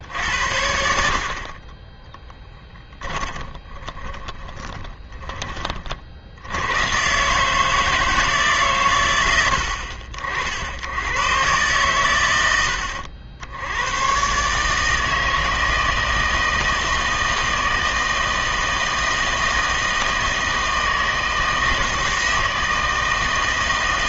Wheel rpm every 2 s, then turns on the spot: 80, 10, 20, 100, 140, 70, 90, 150, 160, 160, 160, 160.
2-6